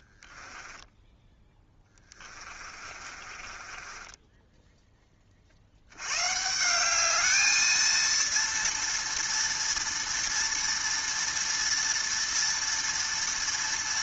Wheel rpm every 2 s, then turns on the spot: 10, 40, 20, 190, 230, 230, 230.
0-4